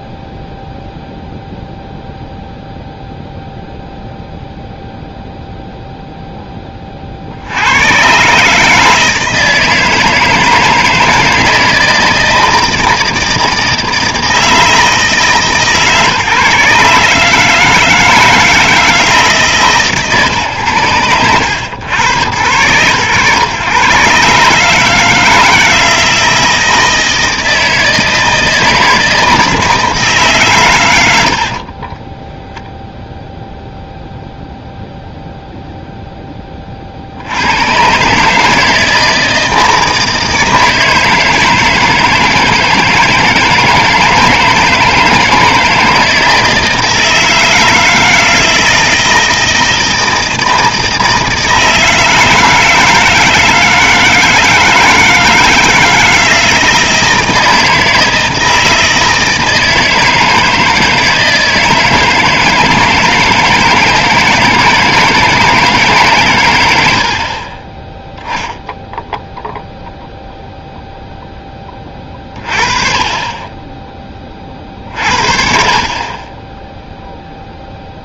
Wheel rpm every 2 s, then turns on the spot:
0, 0, 0, 20, 150, 160, 160, 160, 150, 160, 110, 110, 150, 160, 160, 130, 0, 0, 30, 160, 160, 160, 160, 160, 160, 160, 160, 160, 160, 160, 160, 160, 160, 90, 0, 0, 30, 40, 20.
none